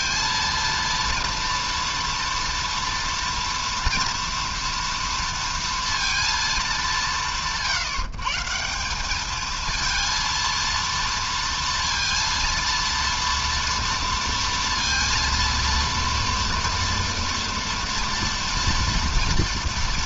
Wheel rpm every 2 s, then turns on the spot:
230, 230, 230, 180, 220, 230, 240, 230, 230, 230.
none